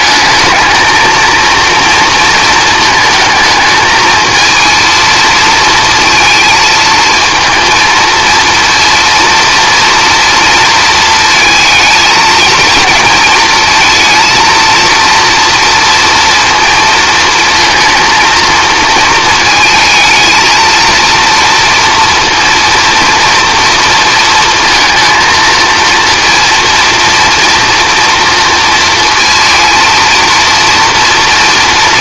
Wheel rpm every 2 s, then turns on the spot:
220, 220, 230, 230, 230, 230, 230, 230, 230, 230, 230, 230, 230, 230, 230, 230.
none